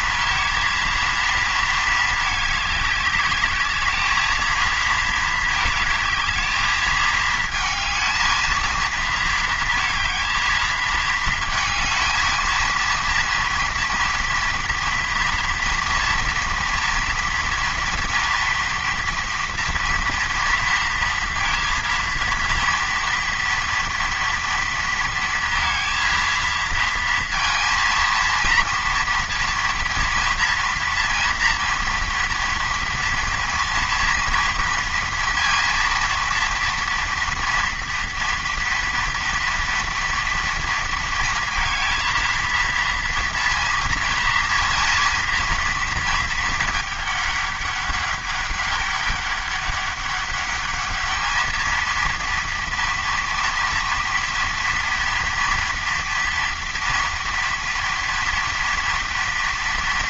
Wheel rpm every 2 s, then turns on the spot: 230, 210, 230, 220, 220, 220, 230, 230, 230, 230, 230, 230, 230, 230, 230, 230, 230, 230, 230, 230, 230, 230, 230, 210, 200, 210, 230, 230, 230, 230.
none